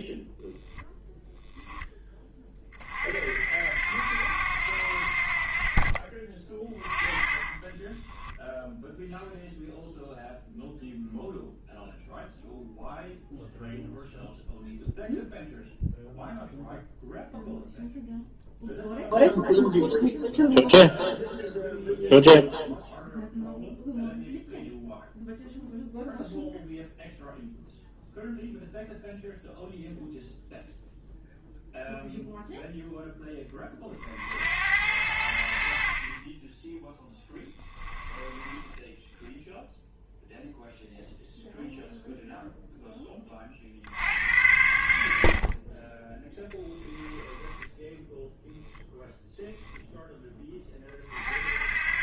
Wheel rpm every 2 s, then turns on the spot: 0, 40, 80, 20, 0, 0, 0, 0, 0, 0, 0, 0, 0, 0, 0, 0, 0, 80, 10, 10, 0, 10, 90, 10, 0, 30.
38-40 46-48